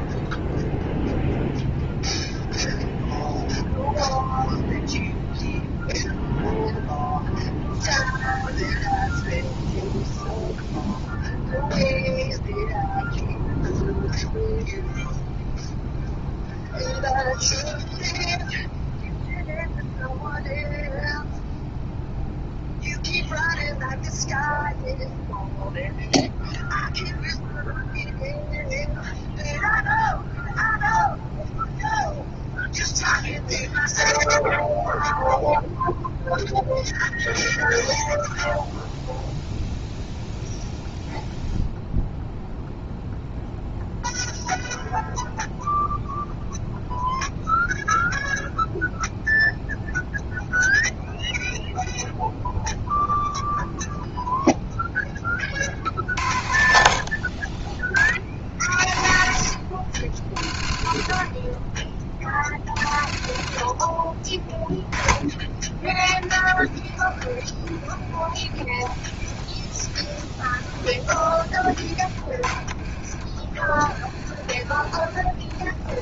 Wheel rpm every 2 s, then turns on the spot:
0, 0, 0, 0, 0, 0, 0, 0, 0, 0, 0, 0, 0, 0, 0, 0, 0, 0, 0, 0, 0, 0, 0, 0, 0, 0, 0, 0, 50, 40, 40, 40, 20, 20, 20, 20, 20, 20.
72-74